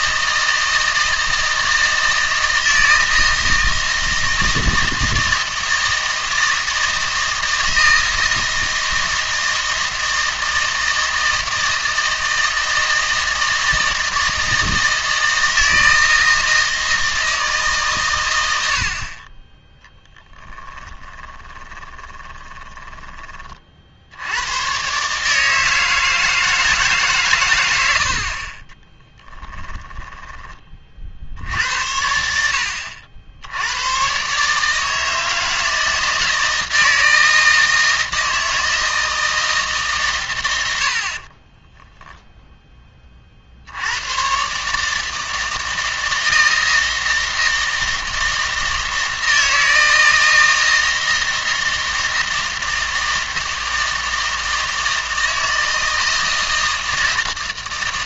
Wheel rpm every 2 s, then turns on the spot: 160, 160, 160, 160, 160, 160, 160, 160, 160, 60, 10, 20, 130, 150, 30, 30, 80, 150, 160, 160, 70, 10, 140, 160, 160, 160, 160, 160, 160.
20-24 28-30